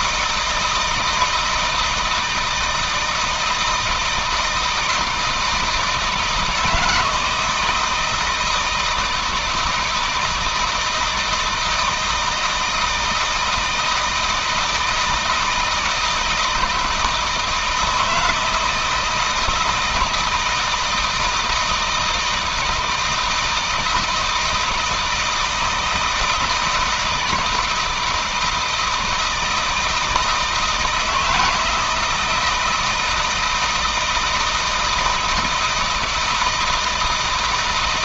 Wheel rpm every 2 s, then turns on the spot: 160, 160, 160, 160, 160, 160, 160, 160, 160, 160, 160, 160, 160, 160, 160, 160, 170, 160, 160.
none